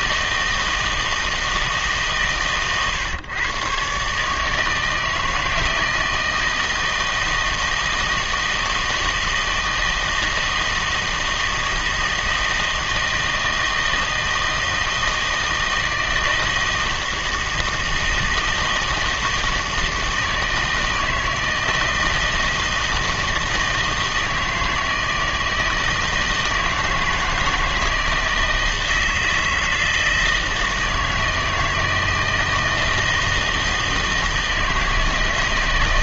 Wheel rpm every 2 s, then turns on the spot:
160, 130, 160, 160, 160, 160, 160, 160, 160, 160, 160, 160, 160, 160, 160, 160, 160, 160.
none